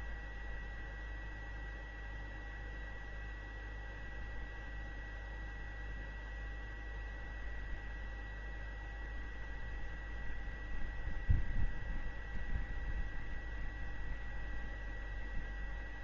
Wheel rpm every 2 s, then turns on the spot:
0, 0, 0, 0, 0, 0, 0, 0.
none